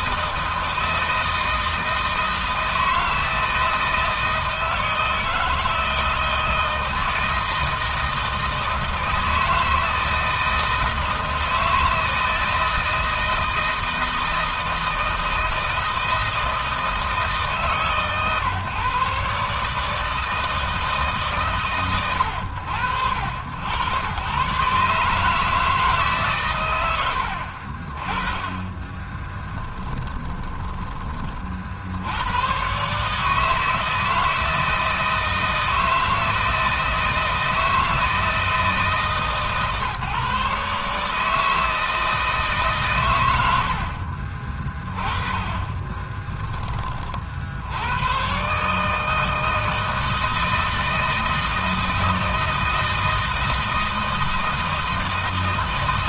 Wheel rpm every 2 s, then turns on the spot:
160, 160, 160, 160, 160, 160, 160, 160, 160, 130, 150, 90, 130, 100, 20, 20, 130, 160, 160, 150, 140, 140, 30, 30, 150, 160, 160, 160.
28-30